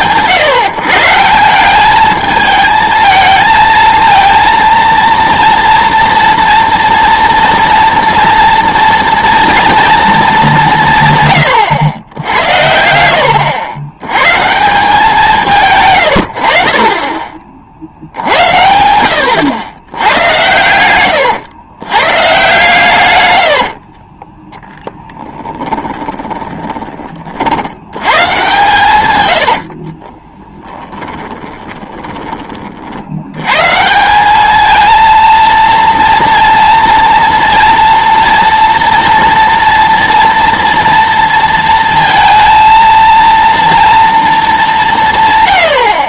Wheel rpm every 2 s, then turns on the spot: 150, 220, 230, 230, 230, 170, 80, 160, 40, 80, 90, 140, 10, 20, 130, 20, 50, 220, 230, 230, 230, 230, 200.
24-28 30-32